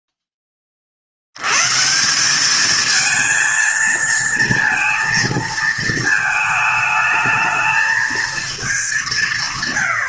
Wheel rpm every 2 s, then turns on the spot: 20, 210, 230, 220, 210.
none